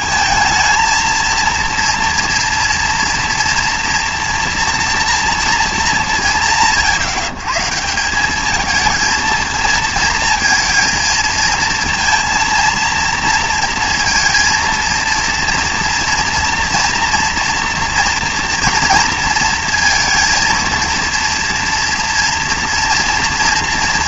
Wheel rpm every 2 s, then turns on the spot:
220, 230, 230, 160, 220, 220, 230, 230, 240, 230, 230, 230.
none